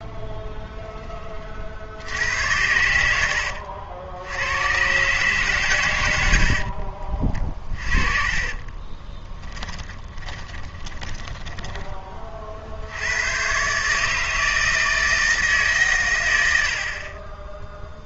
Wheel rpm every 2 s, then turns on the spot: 0, 80, 110, 60, 30, 20, 60, 160, 60.
6-12